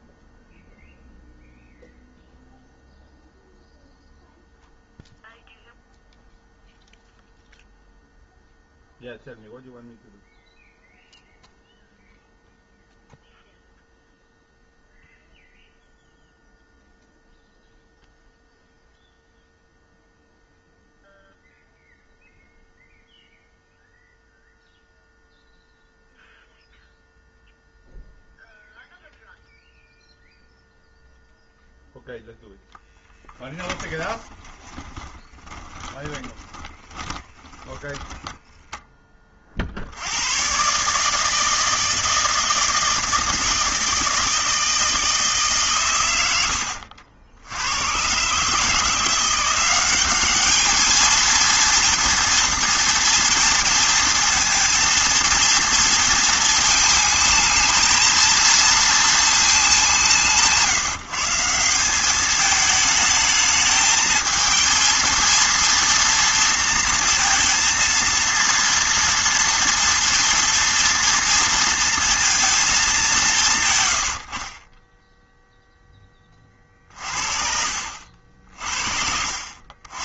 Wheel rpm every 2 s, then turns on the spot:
0, 0, 0, 0, 0, 0, 0, 0, 0, 0, 0, 0, 0, 0, 0, 0, 10, 20, 20, 20, 150, 160, 160, 70, 170, 220, 240, 230, 220, 230, 150, 220, 230, 230, 230, 230, 190, 0, 40, 60.
32-38 76-80